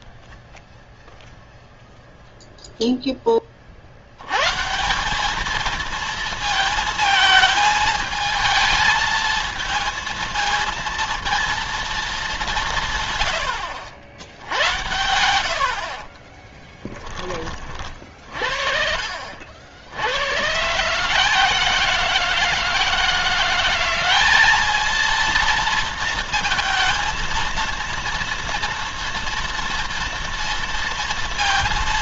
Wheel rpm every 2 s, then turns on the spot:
0, 0, 160, 220, 220, 230, 160, 80, 10, 50, 140, 170, 210, 220, 230, 230.
none